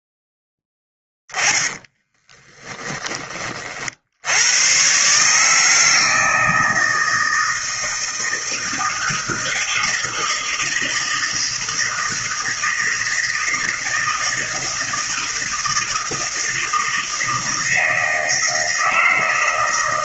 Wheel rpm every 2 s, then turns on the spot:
10, 20, 110, 160, 160, 160, 160, 160, 160, 160.
0-4